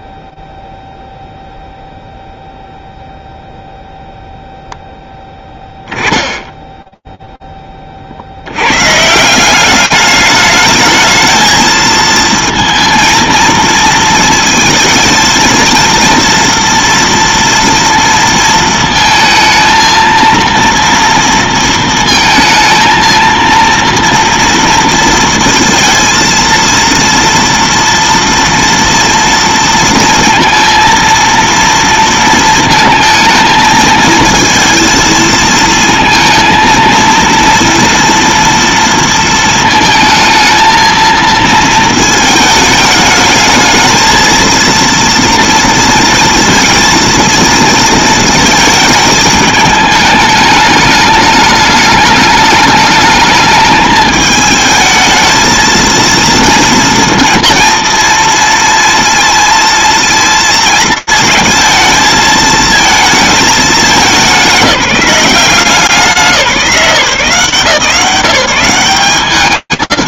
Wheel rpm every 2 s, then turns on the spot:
0, 0, 0, 10, 20, 190, 230, 230, 230, 230, 230, 230, 230, 230, 230, 230, 230, 220, 230, 230, 230, 230, 220, 230, 230, 220, 210, 210, 230, 230, 230, 220, 220, 190, 160.
none